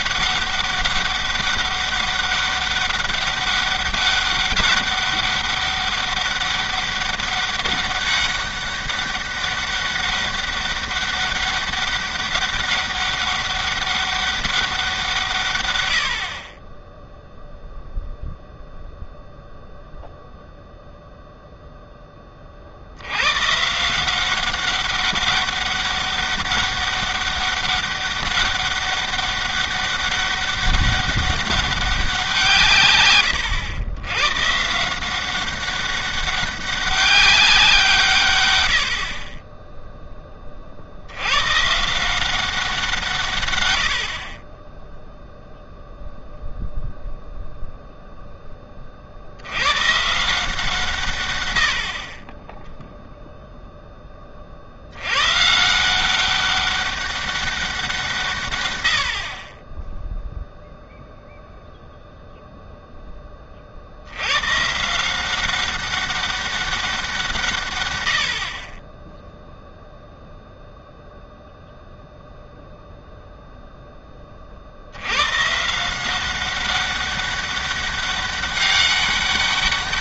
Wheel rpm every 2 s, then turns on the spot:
200, 200, 200, 200, 200, 200, 200, 190, 20, 0, 0, 50, 190, 200, 200, 200, 140, 160, 200, 100, 50, 170, 10, 0, 20, 160, 0, 50, 200, 110, 0, 0, 140, 200, 30, 0, 0, 60, 200, 200.
none